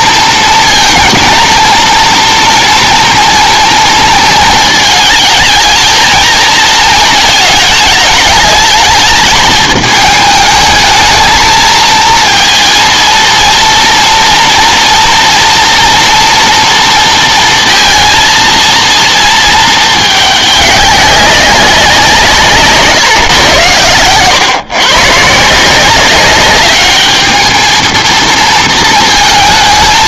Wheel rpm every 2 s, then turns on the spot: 230, 230, 220, 230, 210, 220, 230, 240, 230, 230, 200, 150, 130, 200, 230.
none